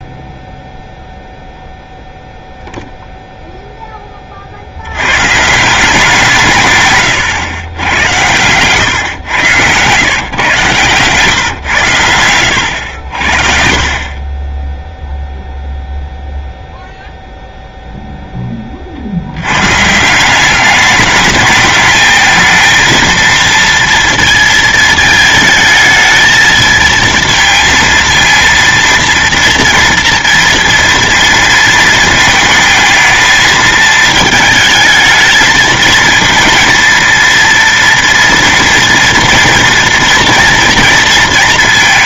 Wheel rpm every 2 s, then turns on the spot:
0, 0, 60, 140, 110, 120, 90, 10, 0, 30, 200, 230, 230, 230, 230, 230, 220, 220, 230, 230, 230.
12-16